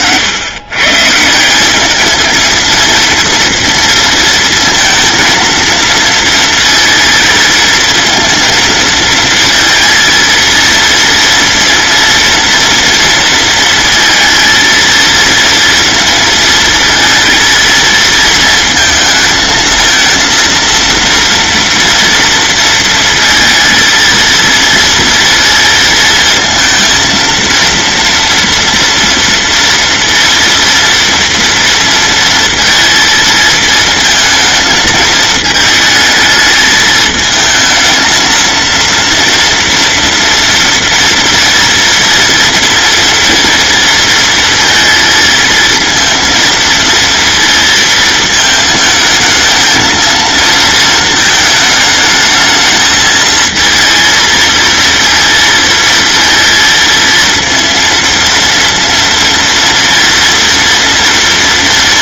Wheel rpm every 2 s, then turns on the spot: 130, 230, 230, 230, 230, 230, 230, 230, 220, 220, 230, 230, 230, 230, 230, 230, 230, 220, 220, 230, 230, 230, 230, 230, 220, 220, 220, 230, 230, 230, 230.
none